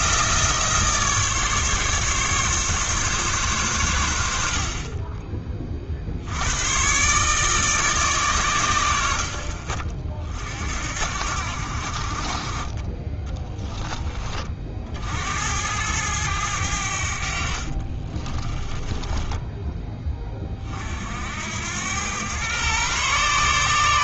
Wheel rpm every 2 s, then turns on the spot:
160, 140, 50, 110, 110, 60, 30, 40, 90, 20, 30, 120.
18-20